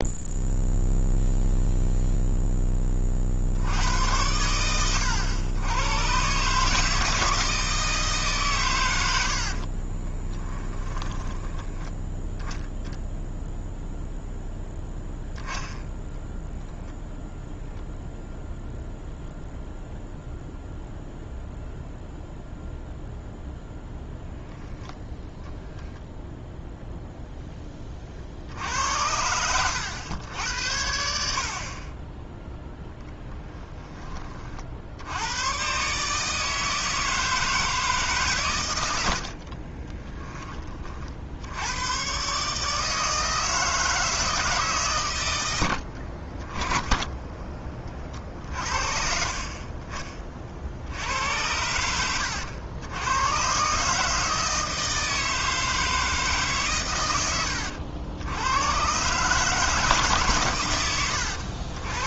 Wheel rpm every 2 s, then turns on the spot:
0, 20, 90, 150, 110, 10, 10, 0, 0, 0, 0, 0, 10, 0, 60, 80, 0, 60, 160, 100, 30, 150, 140, 10, 40, 60, 90, 160, 120, 110, 110.
10-12 46-48